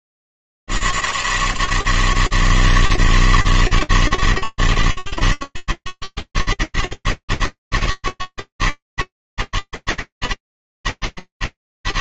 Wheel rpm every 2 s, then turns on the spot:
150, 160, 160, 160, 160, 160.
none